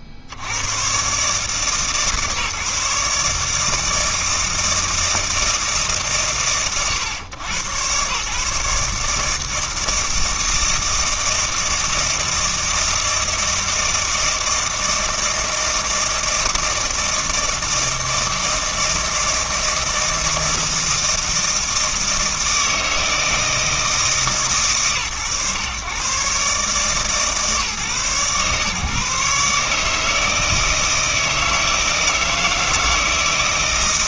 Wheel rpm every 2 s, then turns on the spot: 50, 150, 160, 120, 150, 160, 160, 160, 160, 160, 160, 160, 130, 140, 140, 160, 160.
none